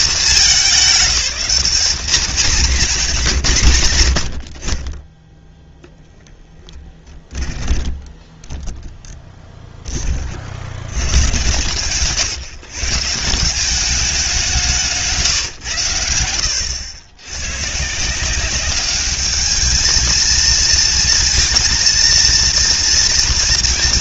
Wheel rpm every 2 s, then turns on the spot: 200, 210, 20, 10, 10, 100, 150, 170, 90, 200, 230, 230.
6-8